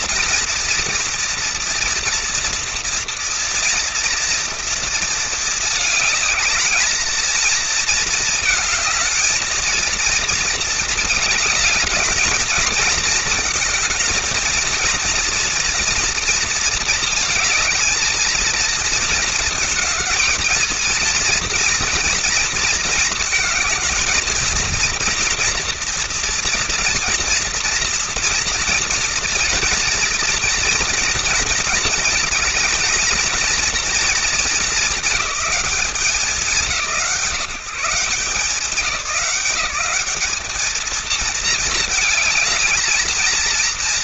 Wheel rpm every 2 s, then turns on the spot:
230, 230, 230, 220, 220, 230, 220, 230, 220, 220, 230, 220, 230, 230, 230, 230, 220, 220, 170, 180, 220, 220.
none